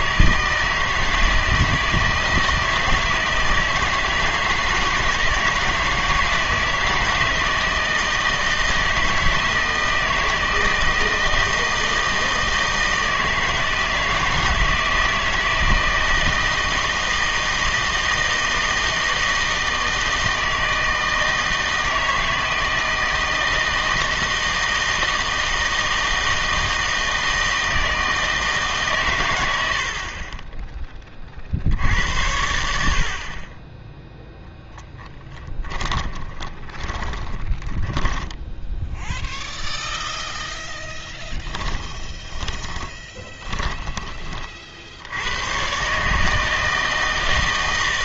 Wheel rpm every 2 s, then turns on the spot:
160, 160, 160, 160, 160, 160, 160, 160, 160, 160, 160, 160, 160, 160, 150, 10, 70, 10, 20, 10, 0, 10, 50, 160.
36-40 42-44